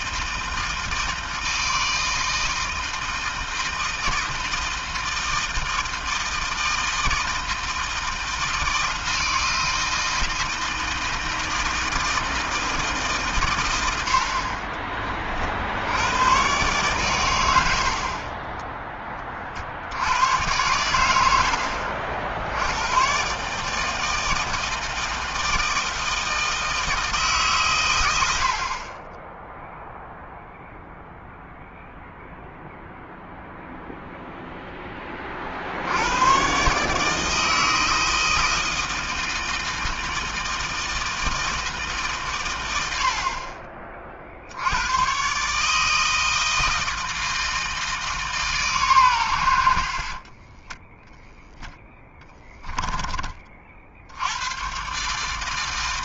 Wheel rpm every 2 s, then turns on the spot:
160, 160, 160, 160, 160, 160, 150, 30, 110, 20, 90, 120, 160, 160, 20, 0, 0, 20, 150, 160, 160, 60, 120, 160, 110, 10, 20, 140.
none